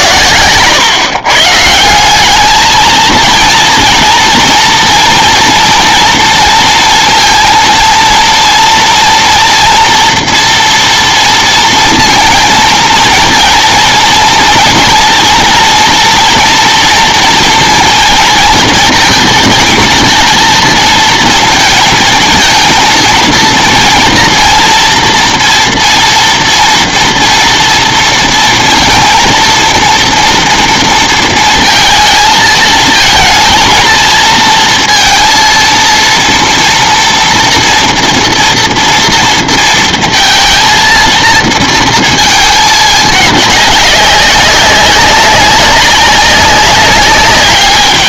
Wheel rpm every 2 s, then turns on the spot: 130, 220, 230, 230, 230, 230, 230, 230, 230, 230, 230, 230, 230, 230, 230, 230, 220, 230, 230, 230, 230, 220, 190, 200.
none